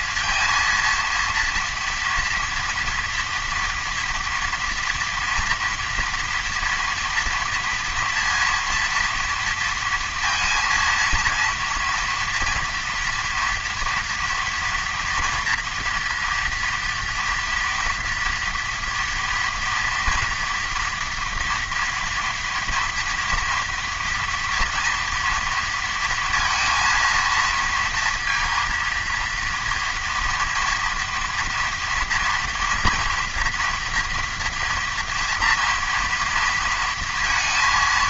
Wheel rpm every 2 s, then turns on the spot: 230, 230, 230, 230, 230, 230, 230, 230, 230, 230, 230, 230, 230, 230, 230, 230, 230, 240, 230.
none